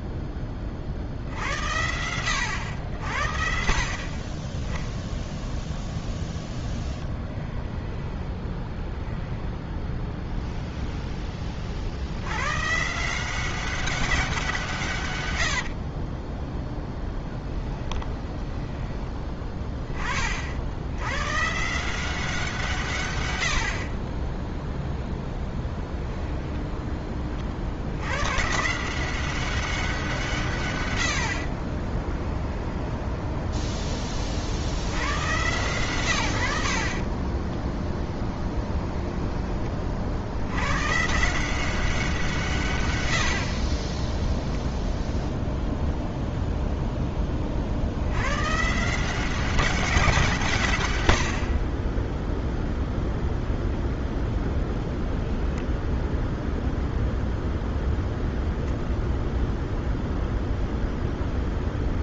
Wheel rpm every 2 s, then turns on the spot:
20, 90, 10, 10, 10, 0, 130, 170, 10, 10, 70, 170, 0, 10, 140, 140, 10, 70, 70, 20, 110, 140, 0, 0, 140, 140, 0, 0, 0, 0, 0.
6-10 16-20 26-28 32-34 38-40